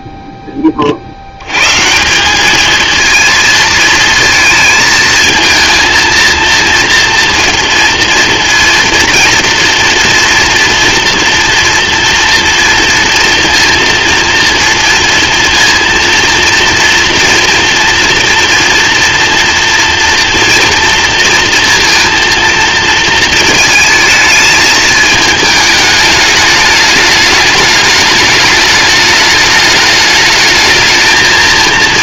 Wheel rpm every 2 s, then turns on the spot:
20, 200, 230, 230, 230, 230, 240, 230, 230, 230, 230, 230, 220, 210, 210, 220.
none